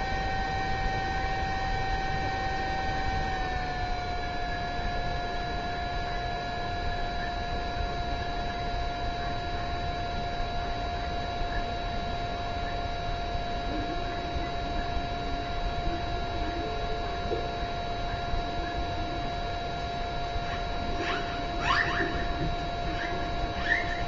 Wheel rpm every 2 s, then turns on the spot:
0, 0, 0, 0, 0, 0, 0, 0, 0, 0, 0, 0.
none